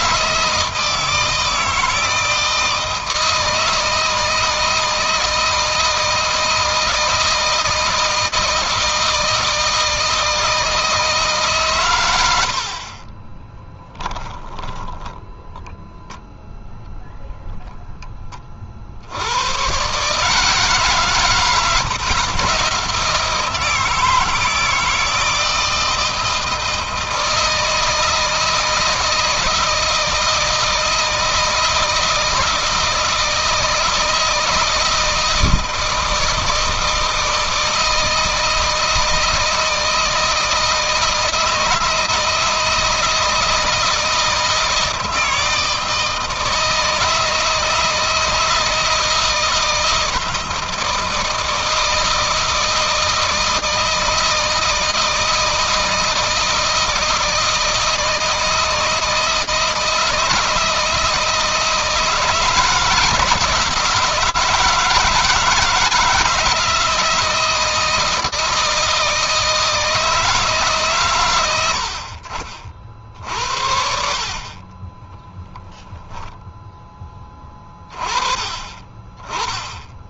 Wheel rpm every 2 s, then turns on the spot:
160, 170, 160, 160, 160, 160, 100, 10, 0, 20, 150, 110, 160, 160, 160, 160, 160, 160, 160, 160, 160, 160, 160, 160, 160, 160, 160, 160, 160, 160, 160, 160, 160, 160, 160, 160, 60, 40, 10, 30.
12-16 74-76